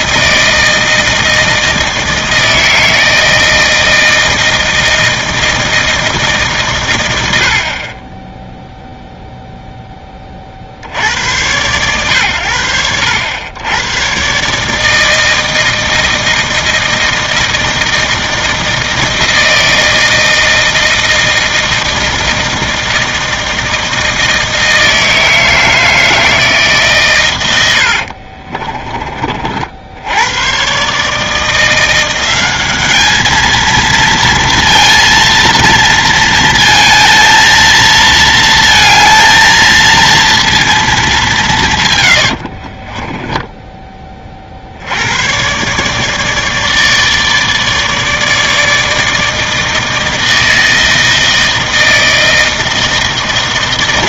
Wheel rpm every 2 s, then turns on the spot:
160, 160, 160, 140, 0, 30, 80, 140, 160, 160, 160, 160, 160, 150, 40, 120, 200, 230, 220, 230, 230, 80, 50, 150, 160, 160, 160.
28-30 42-44